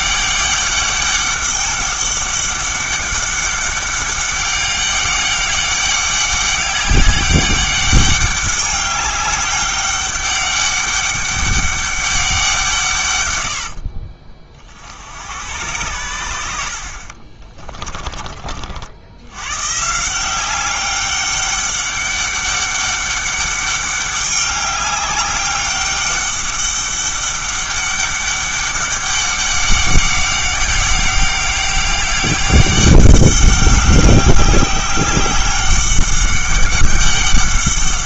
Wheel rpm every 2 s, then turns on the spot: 200, 200, 200, 200, 200, 200, 150, 80, 50, 80, 190, 200, 200, 200, 200, 200, 200, 190, 200.
none